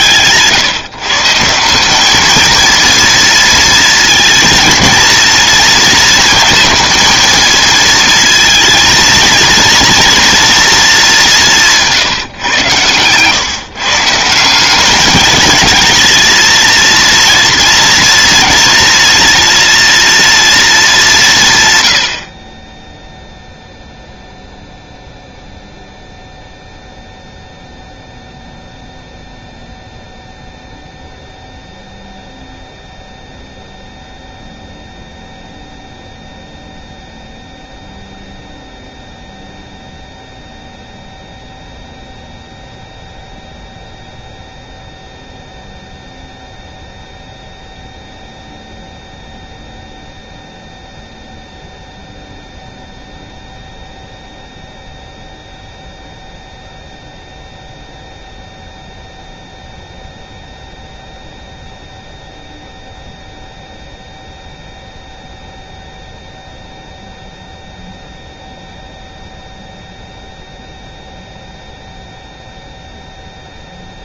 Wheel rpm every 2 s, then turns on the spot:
140, 230, 230, 220, 230, 220, 130, 200, 230, 230, 200, 10, 0, 0, 0, 0, 0, 0, 0, 0, 0, 0, 0, 0, 0, 0, 0, 0, 0, 0, 0, 0, 0, 0, 0, 0, 0.
none